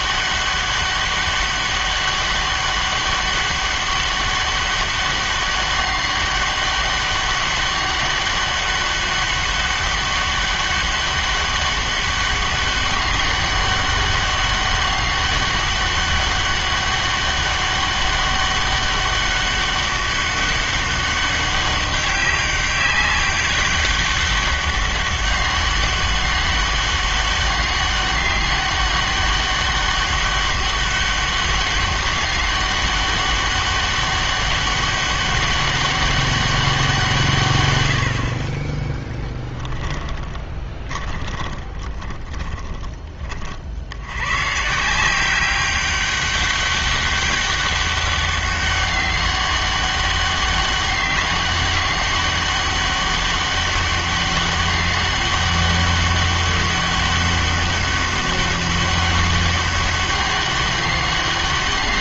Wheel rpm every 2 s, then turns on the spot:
200, 200, 200, 200, 200, 200, 200, 200, 200, 200, 200, 200, 200, 200, 200, 200, 200, 200, 190, 40, 20, 20, 140, 200, 200, 200, 200, 200, 200, 200, 200.
40-44